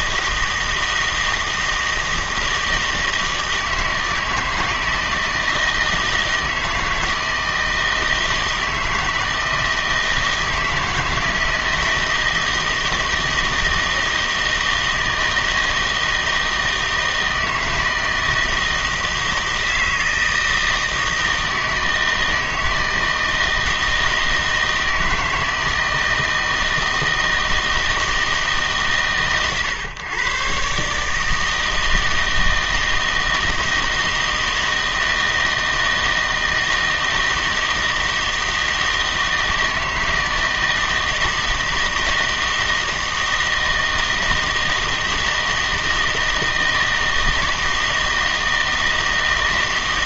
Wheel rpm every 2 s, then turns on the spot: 160, 160, 160, 160, 160, 160, 160, 160, 160, 160, 160, 160, 160, 160, 150, 130, 160, 160, 160, 160, 160, 160, 160, 160, 160.
none